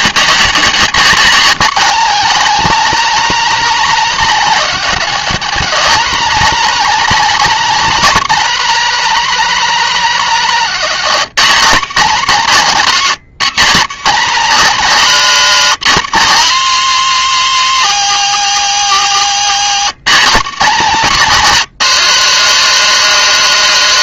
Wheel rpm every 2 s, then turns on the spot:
200, 220, 230, 220, 220, 210, 210, 250, 260, 240, 220, 250.
none